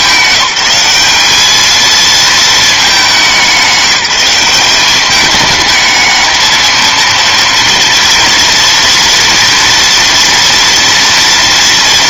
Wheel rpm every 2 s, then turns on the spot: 190, 210, 190, 230, 230, 230.
none